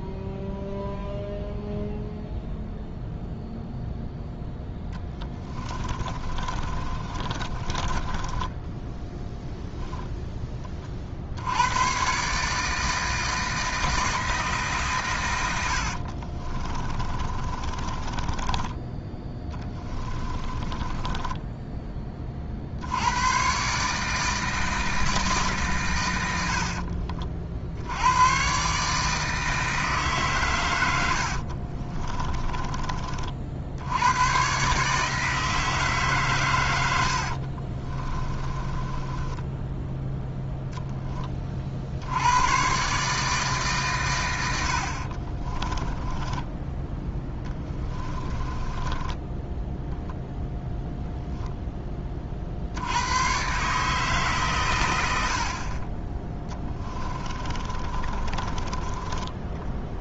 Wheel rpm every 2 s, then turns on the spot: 0, 0, 10, 30, 10, 30, 160, 150, 30, 10, 20, 60, 160, 60, 140, 100, 20, 130, 110, 20, 10, 130, 70, 10, 20, 10, 70, 120, 20, 20.
4-10 16-22 26-28 32-34 38-40 48-50 56-60